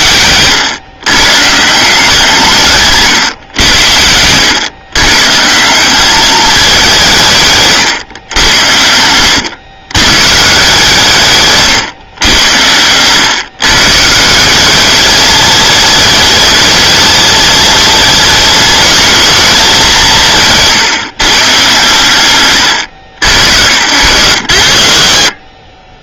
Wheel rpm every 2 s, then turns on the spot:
130, 140, 120, 190, 90, 150, 100, 200, 220, 220, 160, 100, 50.
2-4 8-10 12-14